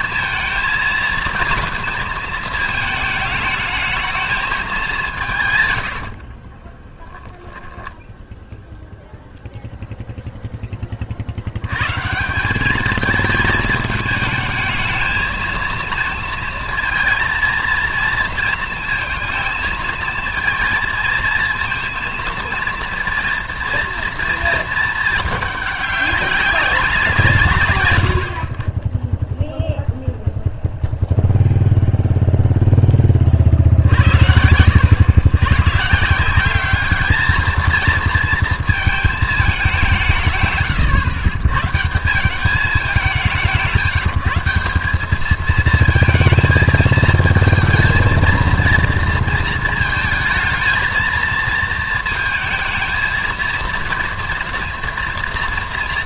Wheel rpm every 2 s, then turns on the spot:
220, 220, 180, 10, 0, 40, 220, 220, 230, 230, 220, 230, 220, 170, 10, 0, 30, 100, 220, 220, 120, 180, 200, 230, 230, 220, 220, 230.
6-8